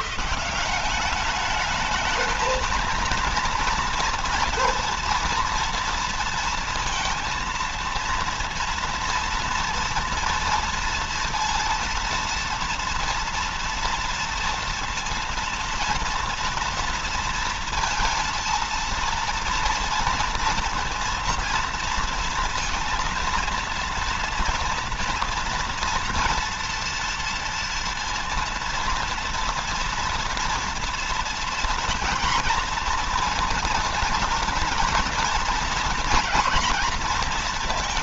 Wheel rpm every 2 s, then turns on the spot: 180, 220, 230, 230, 230, 230, 230, 230, 230, 230, 230, 230, 230, 230, 230, 230, 230, 230, 240.
none